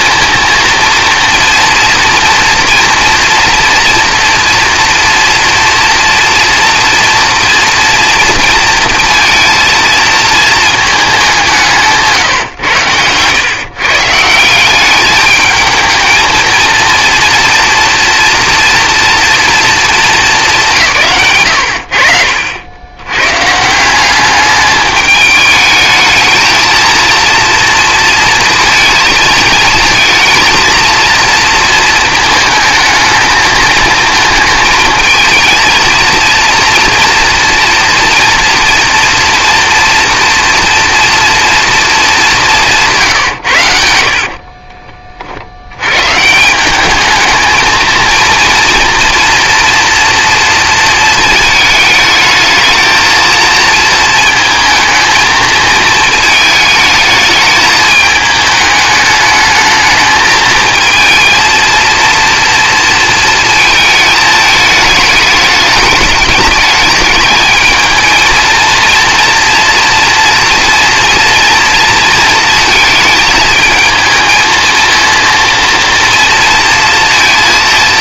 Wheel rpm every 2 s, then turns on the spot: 230, 240, 230, 230, 230, 220, 120, 180, 220, 240, 160, 80, 200, 220, 230, 230, 220, 220, 230, 230, 240, 190, 40, 180, 230, 230, 220, 220, 220, 210, 220, 230, 220, 210, 230, 240, 220, 220, 230.
12-14 44-46